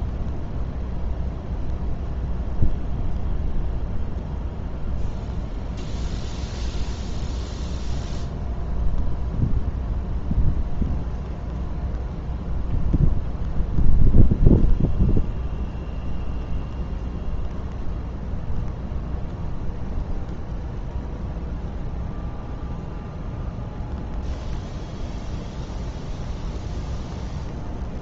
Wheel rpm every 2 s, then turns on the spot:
0, 0, 0, 0, 0, 0, 0, 0, 0, 0, 0, 0, 0, 0.
none